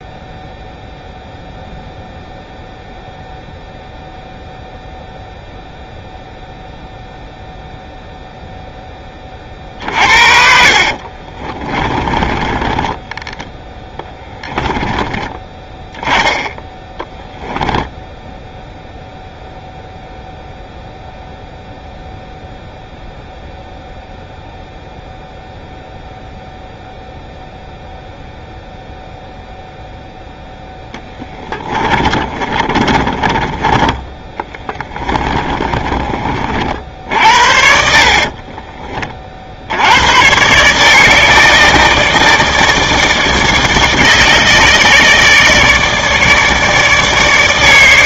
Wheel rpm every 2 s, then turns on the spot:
0, 0, 0, 0, 10, 40, 10, 20, 10, 0, 0, 0, 0, 0, 0, 10, 20, 20, 60, 30, 150, 160, 150, 150.
10-14 30-36